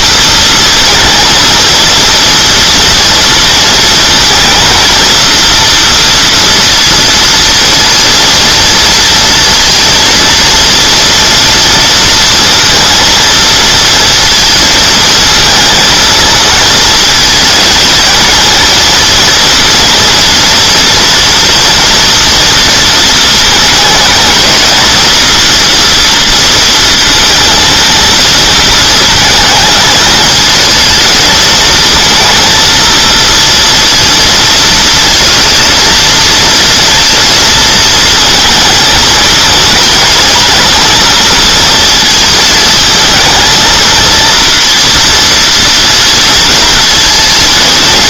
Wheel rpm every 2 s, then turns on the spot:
230, 230, 230, 230, 230, 230, 230, 220, 230, 230, 230, 230, 220, 230, 220, 220, 230, 230, 230, 220, 230, 220, 230, 230.
none